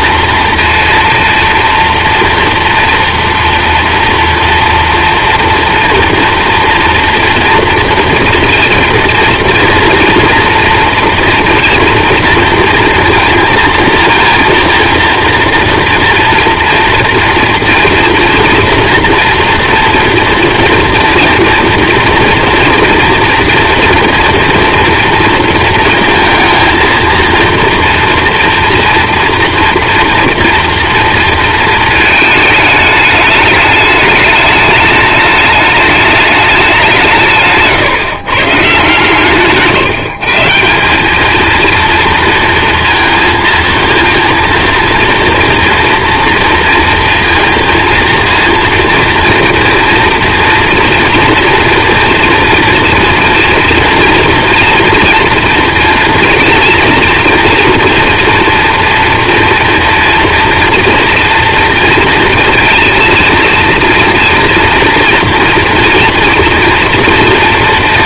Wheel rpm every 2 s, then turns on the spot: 230, 230, 230, 230, 230, 230, 230, 230, 240, 230, 230, 230, 230, 230, 240, 230, 220, 210, 200, 140, 160, 230, 230, 230, 230, 230, 240, 230, 230, 240, 230, 230, 230, 230.
none